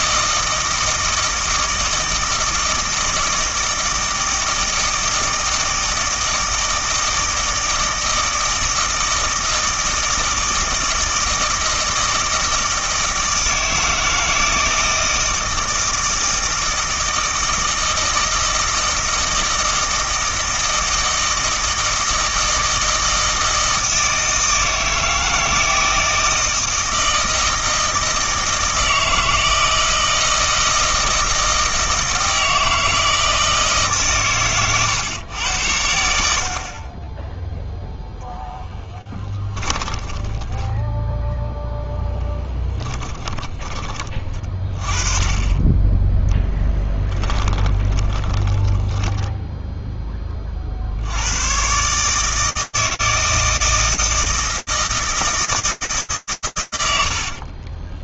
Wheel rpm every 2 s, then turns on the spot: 160, 160, 160, 160, 160, 160, 160, 160, 160, 160, 160, 160, 160, 160, 160, 160, 160, 120, 30, 10, 10, 10, 20, 10, 10, 70, 160, 160, 110.
42-44 46-50 56-58